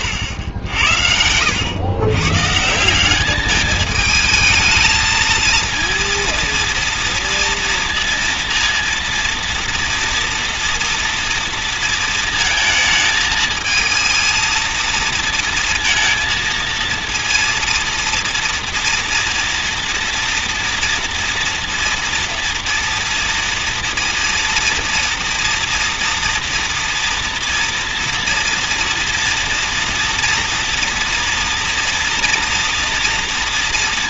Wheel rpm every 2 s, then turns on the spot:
80, 170, 220, 230, 230, 230, 220, 230, 230, 230, 230, 240, 230, 240, 230, 230, 230.
none